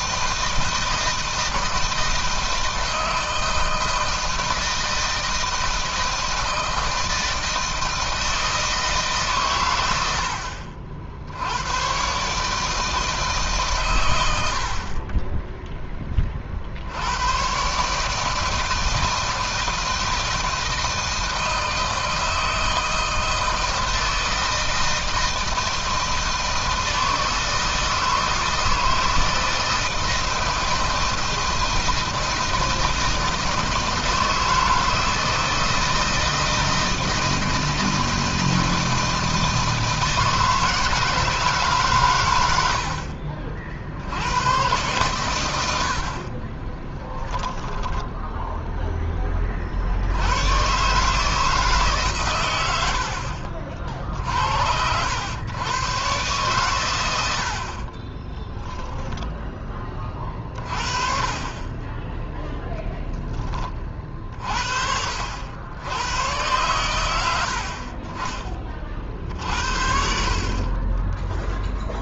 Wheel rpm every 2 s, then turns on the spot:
160, 160, 160, 160, 160, 60, 160, 50, 70, 160, 160, 160, 160, 160, 160, 160, 160, 160, 160, 160, 160, 70, 100, 30, 10, 130, 110, 80, 110, 10, 40, 10, 60, 100, 40, 20.
46-48 70-72